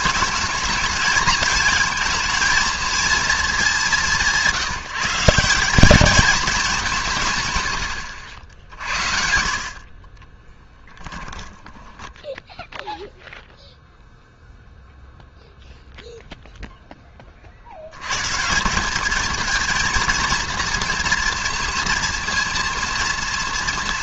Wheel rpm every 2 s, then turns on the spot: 220, 230, 170, 200, 70, 10, 0, 0, 0, 180, 230, 230.
10-12